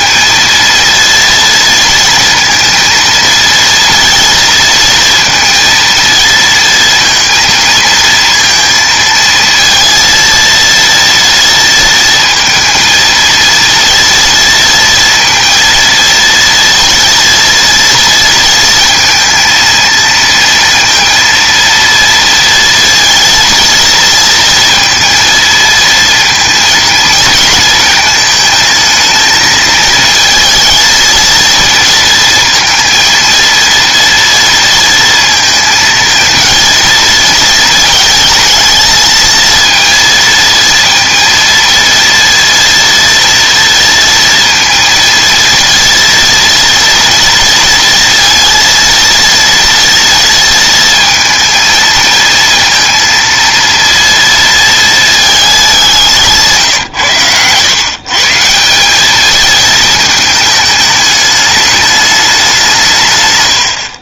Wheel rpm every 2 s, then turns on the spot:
230, 230, 230, 230, 230, 230, 230, 230, 230, 230, 230, 230, 230, 230, 220, 230, 230, 230, 230, 220, 230, 230, 230, 230, 230, 230, 230, 230, 160, 170, 210, 180.
56-58